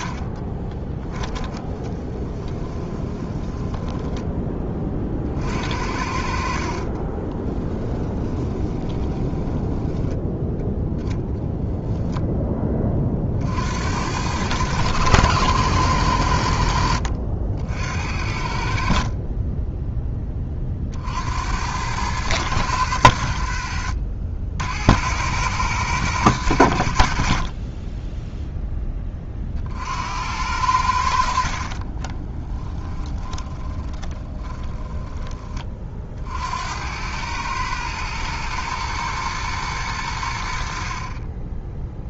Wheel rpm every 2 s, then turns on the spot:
20, 20, 20, 40, 20, 10, 20, 100, 80, 60, 40, 100, 80, 100, 10, 80, 10, 20, 80, 120, 60.
0-4 8-10 32-36